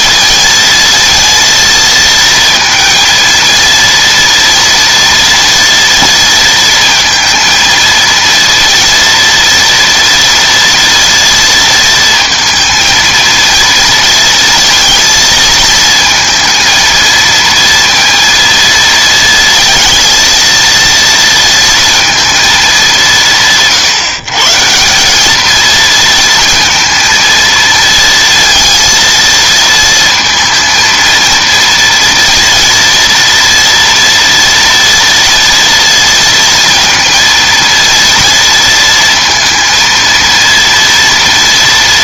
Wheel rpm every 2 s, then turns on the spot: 230, 230, 230, 230, 230, 230, 230, 230, 230, 230, 230, 210, 170, 230, 230, 230, 230, 230, 230, 230, 230.
none